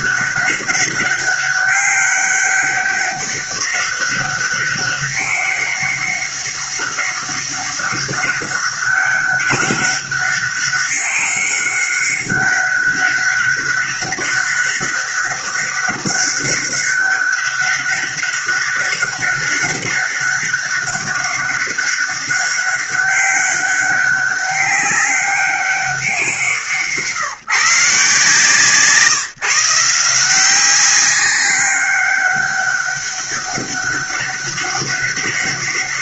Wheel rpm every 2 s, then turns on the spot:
200, 200, 200, 200, 200, 200, 200, 200, 200, 200, 200, 200, 200, 170, 160, 180, 200, 200.
none